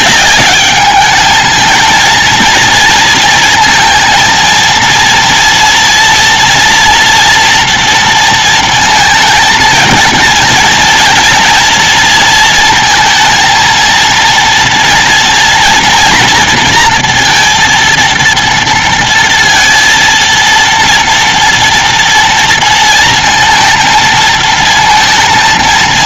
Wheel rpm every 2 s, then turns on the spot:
200, 230, 230, 240, 230, 230, 230, 230, 230, 230, 230, 230, 230.
none